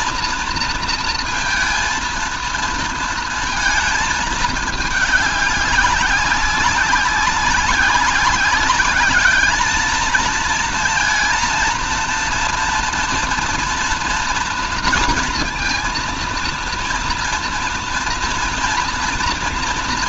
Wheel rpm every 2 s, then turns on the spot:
230, 230, 210, 190, 190, 230, 230, 230, 230, 240.
none